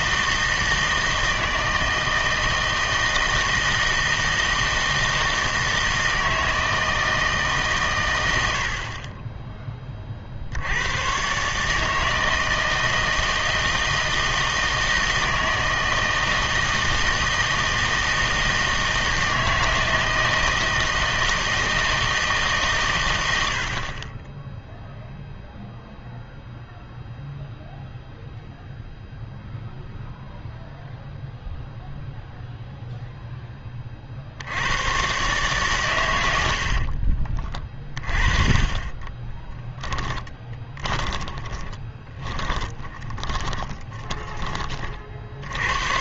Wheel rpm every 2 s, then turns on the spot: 160, 160, 160, 160, 70, 80, 160, 160, 160, 160, 160, 140, 10, 0, 0, 0, 0, 80, 70, 30, 10, 20, 30.
36-44